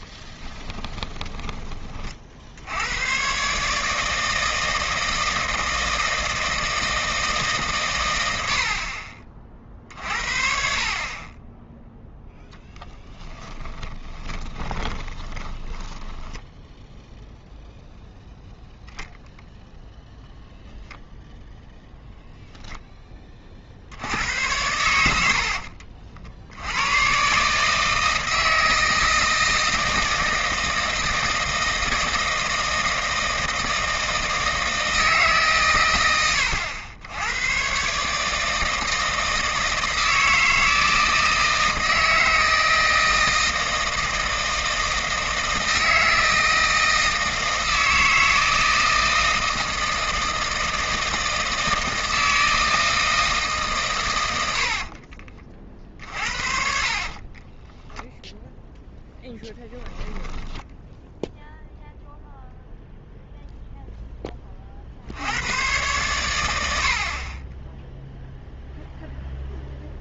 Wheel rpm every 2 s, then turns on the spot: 20, 100, 160, 160, 50, 40, 30, 20, 0, 0, 0, 20, 90, 100, 160, 160, 160, 160, 90, 160, 160, 160, 160, 160, 160, 160, 160, 50, 50, 0, 0, 0, 50, 70, 0.
0-2 12-16 54-58